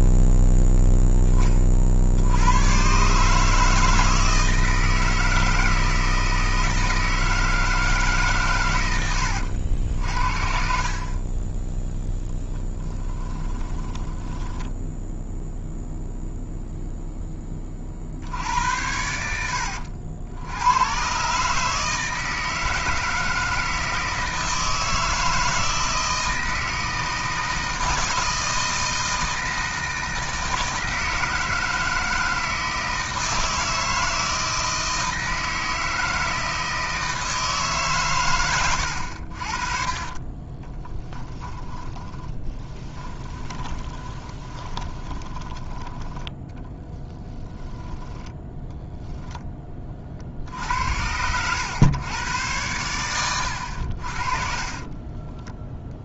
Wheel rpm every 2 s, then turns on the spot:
0, 120, 160, 160, 110, 50, 10, 10, 0, 80, 100, 160, 160, 160, 160, 160, 160, 160, 160, 90, 20, 20, 20, 20, 10, 70, 110, 30.
12-16 38-48 50-52 54-56